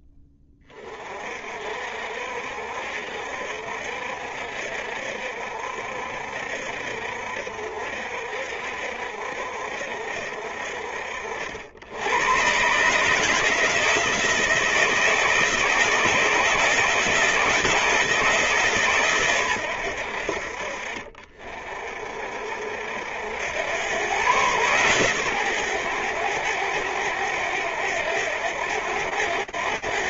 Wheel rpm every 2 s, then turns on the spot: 20, 60, 60, 60, 60, 80, 160, 160, 170, 100, 40, 100, 120, 90, 90.
none